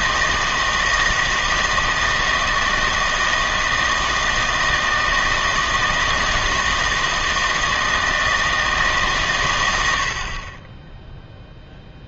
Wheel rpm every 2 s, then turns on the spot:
160, 160, 160, 160, 160, 30.
none